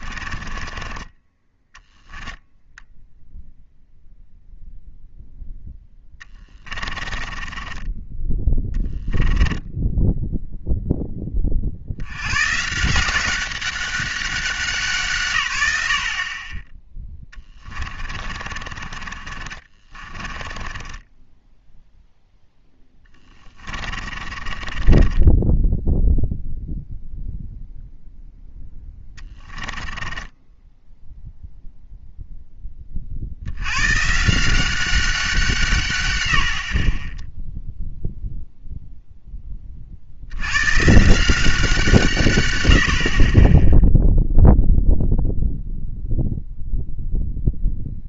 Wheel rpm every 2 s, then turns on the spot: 0, 0, 20, 10, 10, 150, 170, 10, 40, 10, 10, 30, 0, 0, 10, 0, 140, 100, 0, 50, 170, 0, 0, 0.
4-8 16-20 22-24 28-30